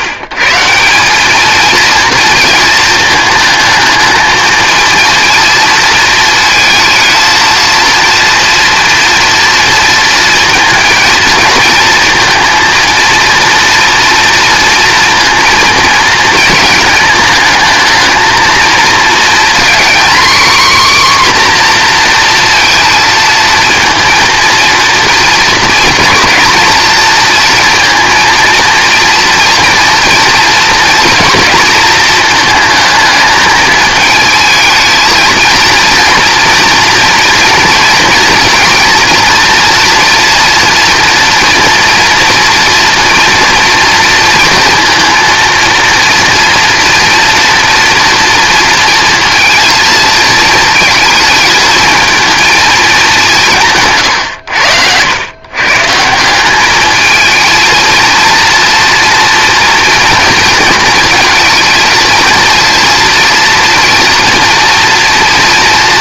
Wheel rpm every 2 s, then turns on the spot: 190, 220, 220, 220, 230, 230, 230, 230, 220, 220, 260, 230, 230, 220, 230, 230, 220, 220, 230, 230, 230, 230, 230, 240, 230, 220, 210, 90, 210, 230, 220, 230, 230.
none